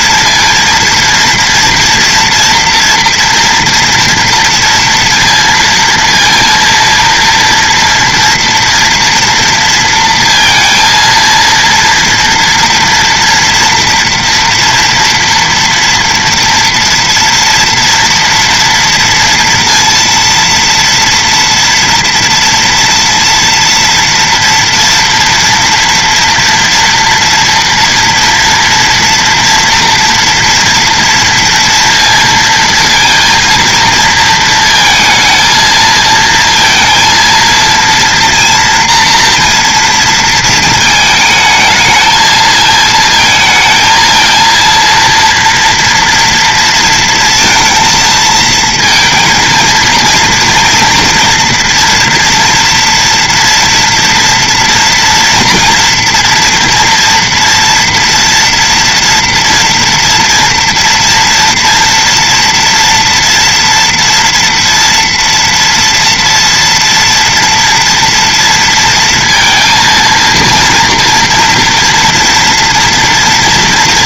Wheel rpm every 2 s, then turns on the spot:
230, 230, 230, 230, 230, 230, 230, 230, 230, 230, 230, 230, 230, 230, 230, 240, 230, 220, 230, 230, 220, 220, 230, 230, 230, 230, 240, 240, 230, 240, 230, 230, 230, 230, 230, 230, 230.
none